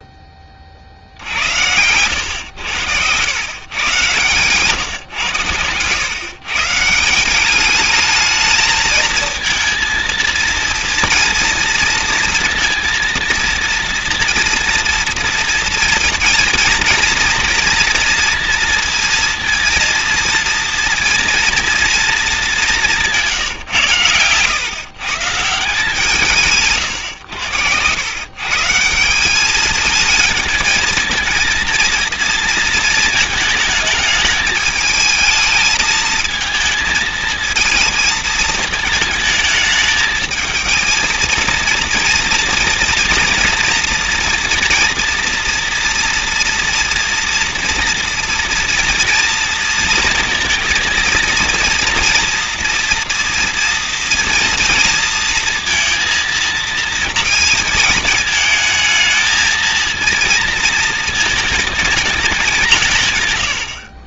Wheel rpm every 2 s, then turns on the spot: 30, 100, 120, 140, 220, 230, 230, 230, 230, 230, 230, 200, 130, 140, 150, 220, 230, 210, 220, 220, 220, 230, 230, 230, 240, 230, 240, 230, 220, 220, 230, 180.
none